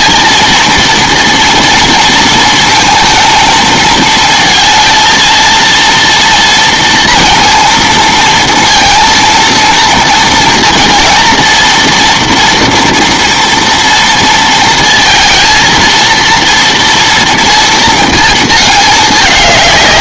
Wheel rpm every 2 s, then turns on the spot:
230, 230, 220, 230, 230, 230, 230, 230, 230, 210.
none